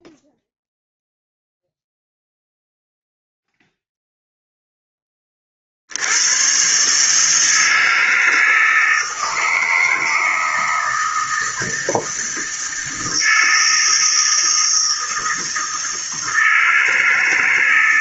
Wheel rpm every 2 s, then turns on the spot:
0, 0, 10, 130, 160, 160, 160, 160, 160.
none